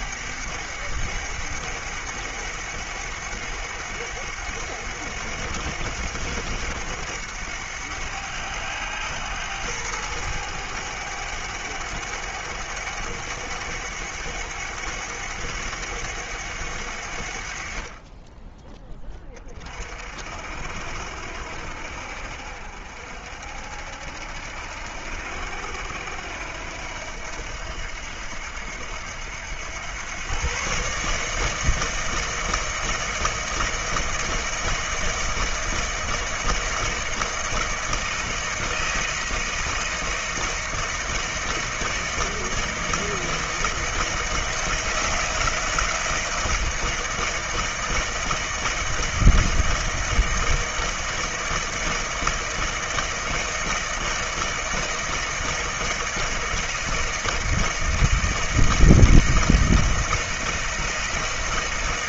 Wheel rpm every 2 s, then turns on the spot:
100, 100, 100, 100, 100, 100, 100, 100, 90, 20, 70, 60, 80, 80, 80, 140, 160, 160, 160, 160, 160, 160, 160, 160, 160, 160, 160, 160, 160, 160, 160.
none